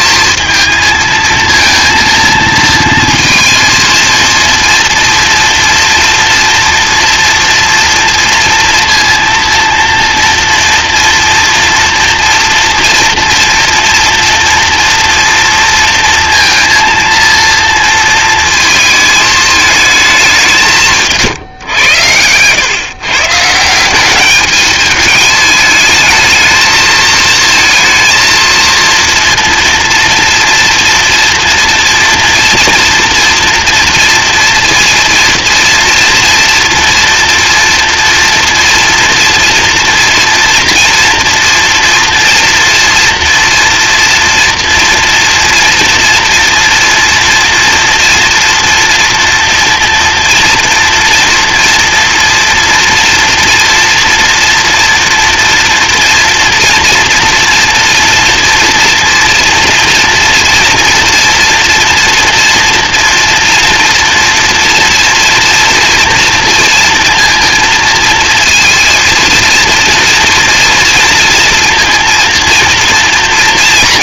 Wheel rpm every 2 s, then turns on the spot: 230, 230, 230, 230, 230, 230, 240, 230, 230, 220, 180, 130, 210, 220, 230, 240, 230, 230, 230, 230, 230, 230, 230, 230, 230, 230, 240, 230, 230, 230, 230, 230, 230, 230, 230, 230, 230.
none